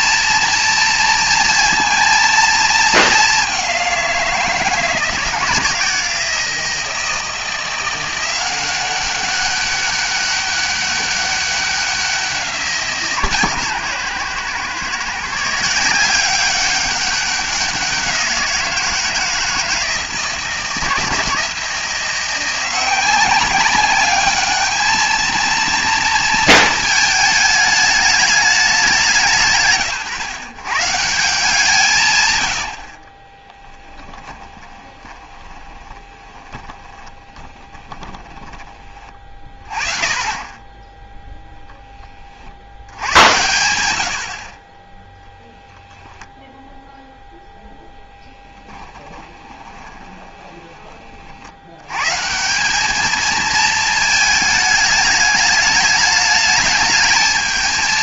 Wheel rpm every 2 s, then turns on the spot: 230, 220, 170, 160, 190, 200, 160, 140, 200, 170, 160, 180, 220, 220, 190, 120, 100, 20, 20, 20, 10, 80, 10, 0, 10, 20, 200, 210, 210.
34-38 48-50